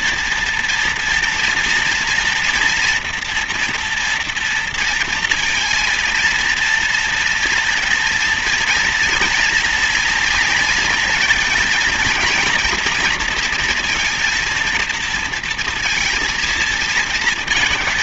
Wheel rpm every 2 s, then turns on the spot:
230, 240, 240, 230, 230, 230, 230, 230, 230.
none